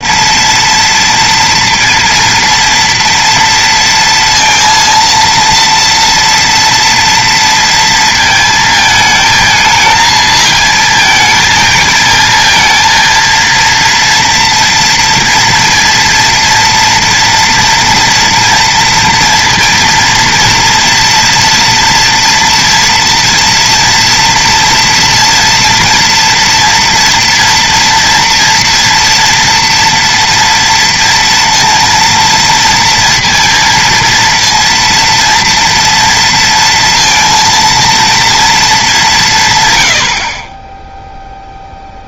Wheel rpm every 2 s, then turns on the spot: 230, 230, 230, 230, 230, 220, 220, 230, 230, 240, 230, 230, 230, 240, 230, 240, 230, 230, 230, 230, 30.
none